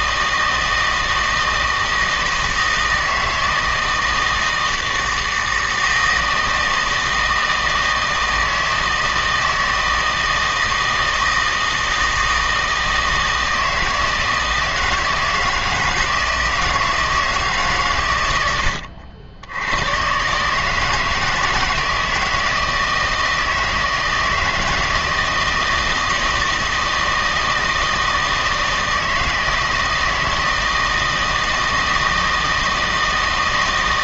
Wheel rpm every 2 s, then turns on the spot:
160, 160, 160, 160, 160, 160, 160, 160, 160, 100, 140, 160, 160, 160, 160, 170, 160.
none